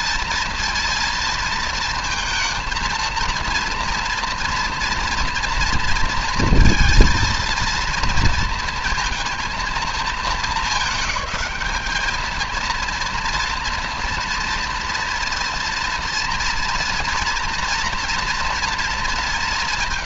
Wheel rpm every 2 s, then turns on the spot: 220, 230, 230, 230, 230, 210, 230, 230, 230, 220.
none